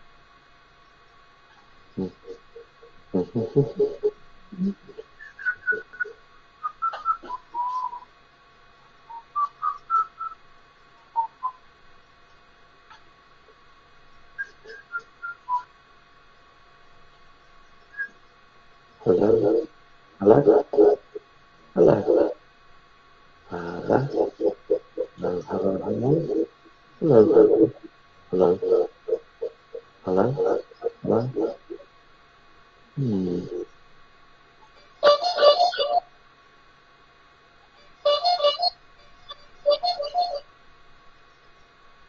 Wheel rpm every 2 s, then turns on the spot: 0, 0, 0, 0, 0, 0, 0, 0, 0, 0, 0, 0, 0, 0, 0, 0, 0, 0, 0, 0, 0.
none